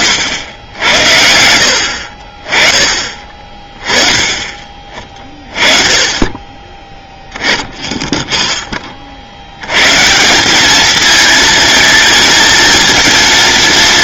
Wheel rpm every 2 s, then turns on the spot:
80, 30, 30, 10, 30, 220, 230.
none